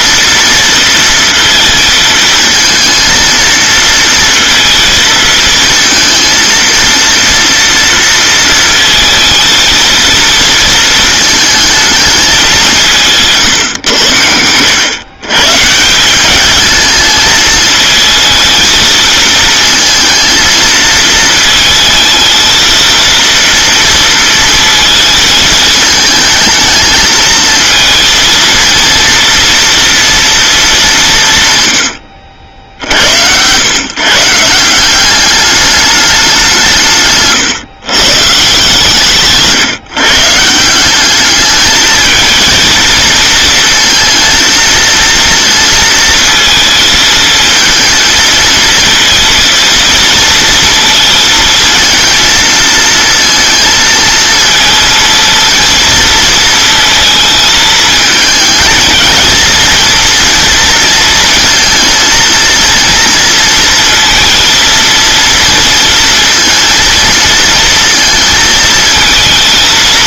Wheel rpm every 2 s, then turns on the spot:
230, 230, 220, 230, 230, 220, 180, 110, 210, 230, 220, 230, 230, 220, 230, 190, 80, 180, 160, 150, 180, 220, 230, 220, 230, 220, 230, 230, 230, 220, 230, 230, 230, 230, 220.
none